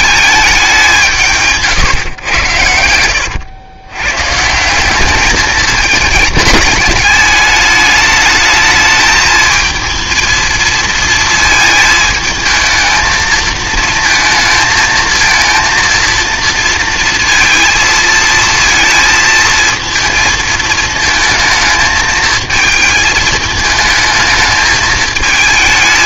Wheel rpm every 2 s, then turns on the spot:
210, 110, 160, 210, 220, 230, 220, 220, 230, 230, 220, 220, 220.
none